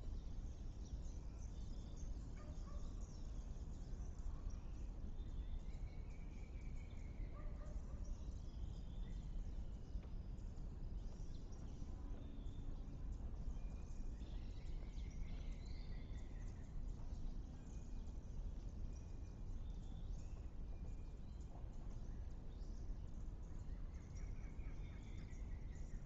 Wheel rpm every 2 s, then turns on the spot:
0, 0, 0, 0, 0, 0, 0, 0, 0, 0, 0, 0, 0.
none